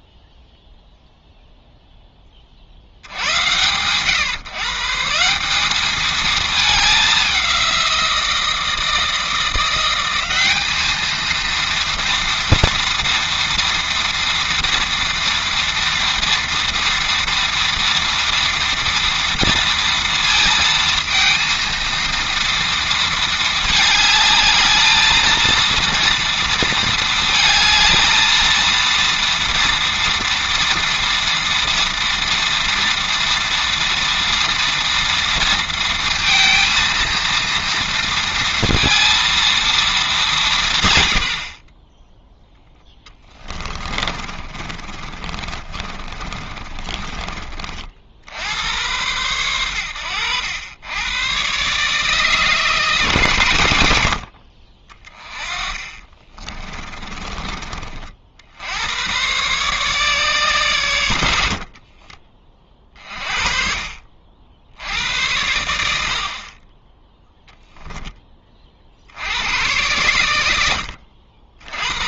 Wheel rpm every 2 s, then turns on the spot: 0, 70, 150, 210, 170, 210, 230, 230, 230, 230, 230, 230, 220, 220, 230, 230, 230, 230, 230, 230, 130, 10, 30, 30, 90, 100, 150, 40, 20, 90, 100, 30, 80, 20, 40, 80.
42-48 56-58